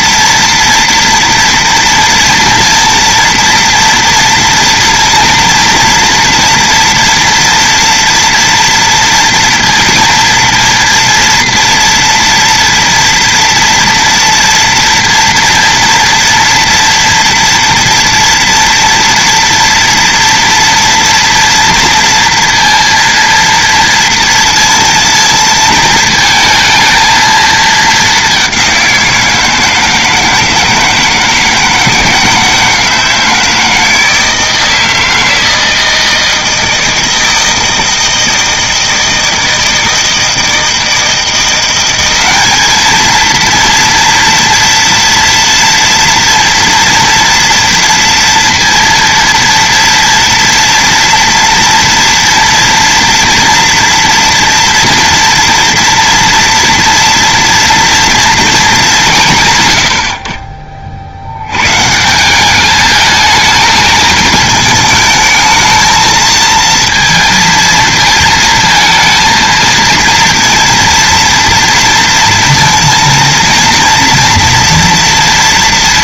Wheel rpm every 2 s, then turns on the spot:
230, 230, 230, 230, 230, 230, 230, 230, 230, 230, 230, 230, 230, 220, 190, 160, 160, 160, 160, 160, 160, 210, 230, 230, 230, 230, 230, 240, 230, 210, 50, 210, 220, 220, 230, 230, 230, 240.
none